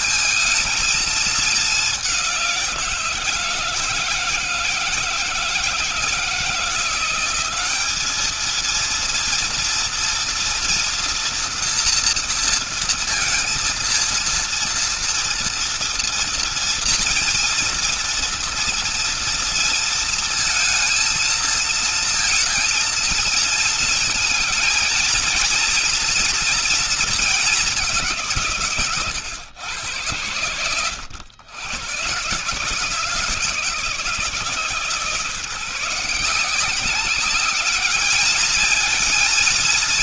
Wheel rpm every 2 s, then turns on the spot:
220, 180, 160, 170, 210, 230, 230, 230, 230, 230, 230, 230, 220, 230, 160, 90, 120, 160, 170, 210.
none